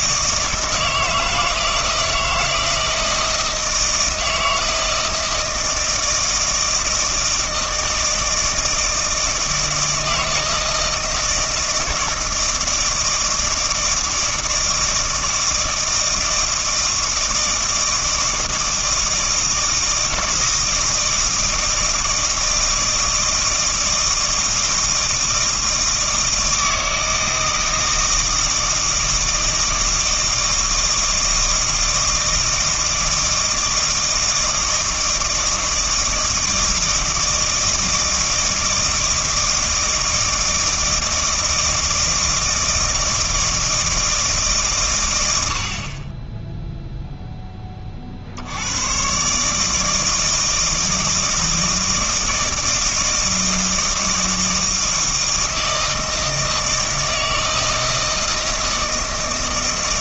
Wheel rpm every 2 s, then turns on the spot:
160, 160, 160, 160, 160, 160, 160, 160, 160, 160, 160, 160, 160, 160, 160, 160, 160, 160, 160, 160, 160, 160, 130, 0, 100, 160, 160, 160, 160, 160.
none